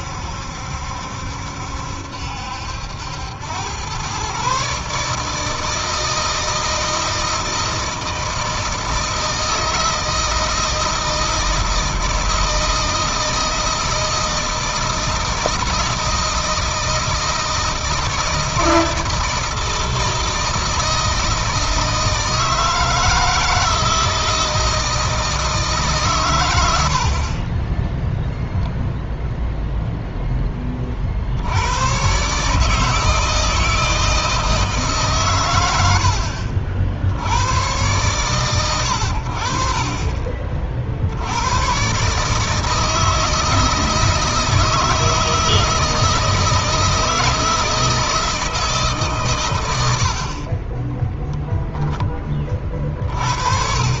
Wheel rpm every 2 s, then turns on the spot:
70, 80, 140, 160, 160, 160, 160, 160, 160, 160, 160, 160, 160, 80, 0, 30, 150, 140, 60, 110, 50, 160, 160, 160, 150, 20, 30.
50-52